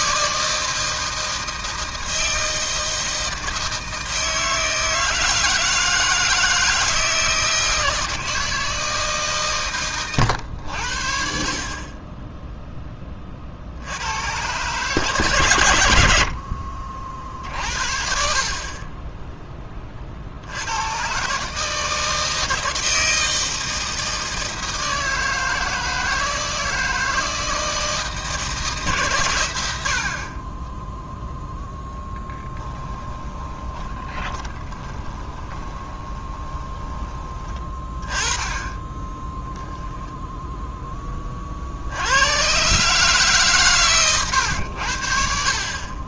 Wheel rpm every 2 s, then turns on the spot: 160, 160, 160, 160, 160, 80, 10, 130, 50, 30, 100, 160, 160, 160, 140, 10, 10, 20, 20, 20, 10, 140, 100.
30-38